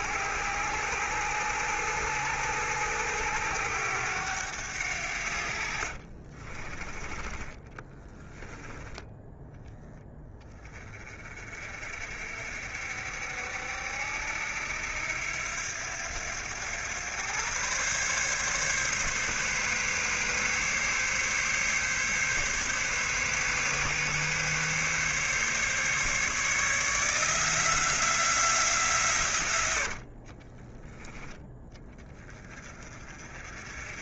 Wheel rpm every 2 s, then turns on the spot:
90, 90, 80, 30, 10, 30, 60, 80, 100, 140, 140, 140, 140, 160, 150, 20, 40.
none